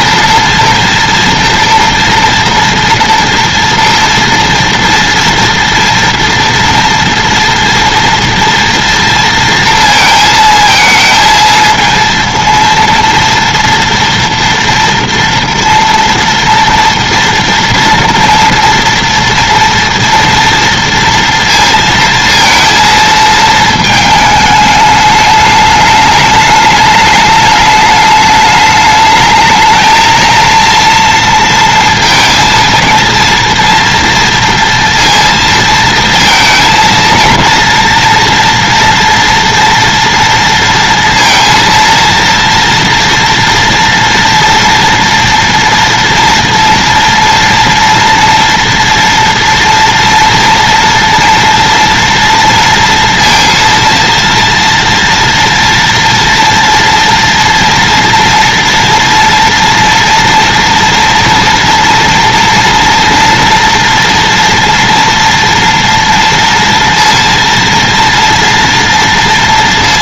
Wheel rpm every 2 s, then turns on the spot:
230, 230, 230, 230, 230, 220, 230, 230, 230, 230, 230, 230, 210, 210, 210, 230, 230, 230, 230, 230, 230, 230, 230, 230, 240, 230, 230, 230, 230, 230, 230, 230, 230, 230, 230.
none